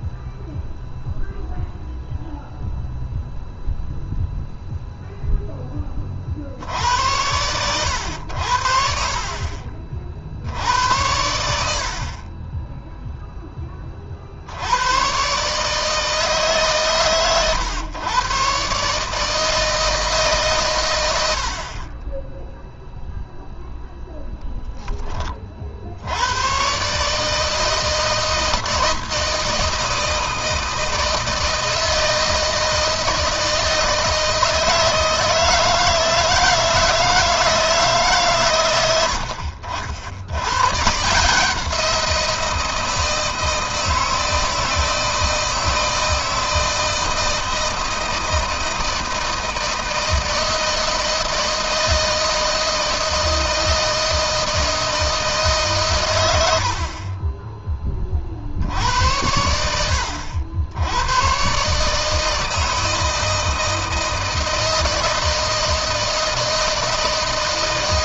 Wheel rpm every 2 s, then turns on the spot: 0, 0, 0, 80, 60, 80, 10, 100, 140, 150, 110, 0, 10, 140, 160, 160, 160, 160, 160, 90, 140, 170, 170, 160, 160, 160, 160, 160, 40, 80, 100, 160, 160, 160.
none